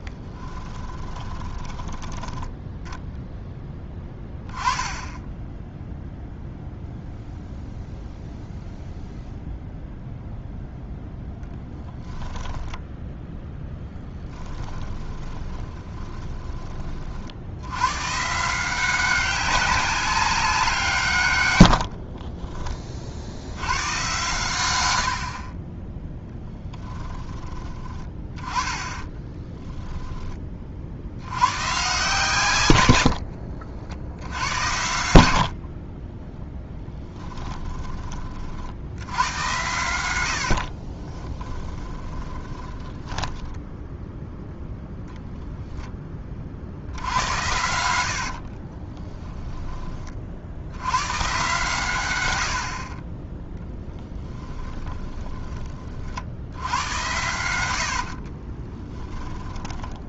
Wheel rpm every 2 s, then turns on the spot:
20, 10, 10, 0, 0, 0, 10, 10, 30, 180, 170, 30, 100, 10, 20, 50, 100, 90, 10, 80, 40, 10, 0, 70, 30, 90, 60, 20, 90, 20.
0-2 12-16 36-38 40-44 48-50 54-56 58-60